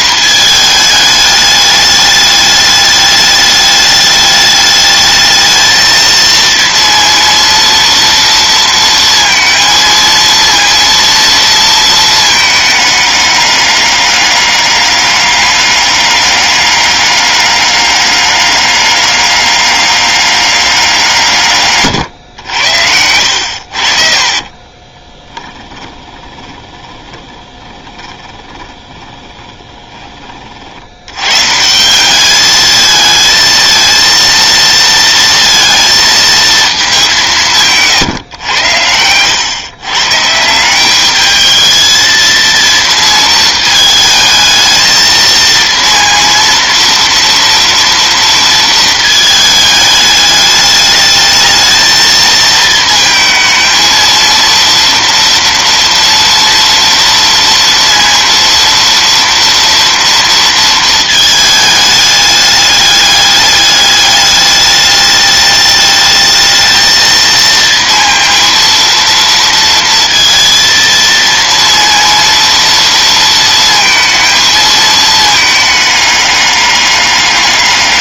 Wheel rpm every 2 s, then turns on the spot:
220, 210, 210, 230, 230, 230, 210, 200, 200, 200, 190, 80, 20, 20, 20, 60, 220, 230, 220, 110, 170, 230, 220, 230, 230, 210, 220, 230, 230, 230, 230, 210, 210, 220, 230, 230, 230, 220, 200.
24-30